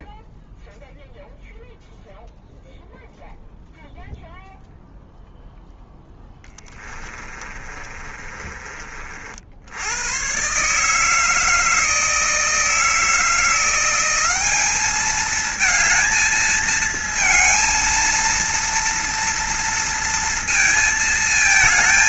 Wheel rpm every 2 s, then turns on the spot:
0, 0, 0, 20, 30, 140, 160, 200, 220, 230, 230.
6-8